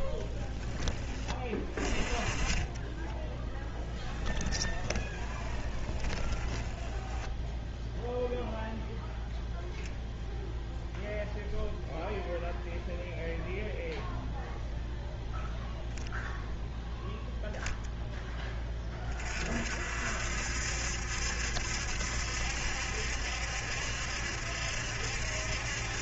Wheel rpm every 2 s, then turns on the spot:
20, 10, 20, 10, 0, 0, 0, 0, 0, 30, 70, 70, 70.
2-8